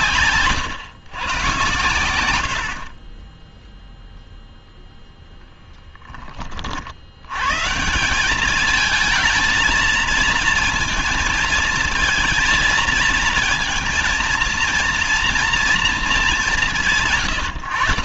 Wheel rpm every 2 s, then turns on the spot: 130, 60, 0, 50, 210, 230, 220, 230, 180.
none